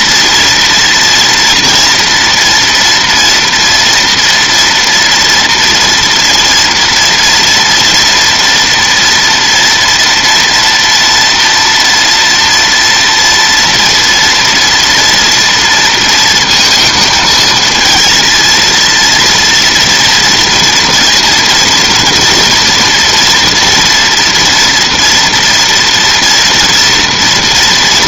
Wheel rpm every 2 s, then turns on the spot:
240, 230, 230, 230, 230, 230, 230, 230, 230, 230, 230, 230, 230, 230.
none